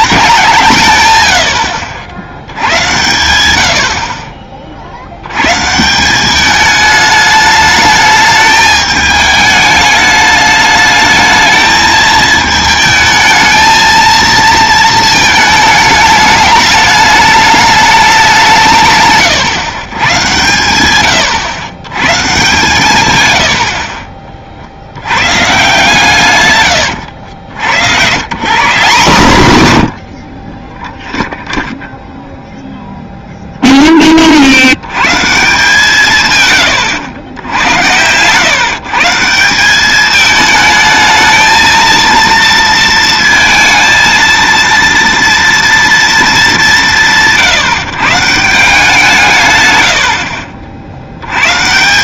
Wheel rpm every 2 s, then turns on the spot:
150, 100, 50, 210, 210, 210, 220, 220, 210, 160, 110, 130, 70, 110, 170, 10, 0, 80, 100, 140, 220, 230, 230, 180, 160, 60.
none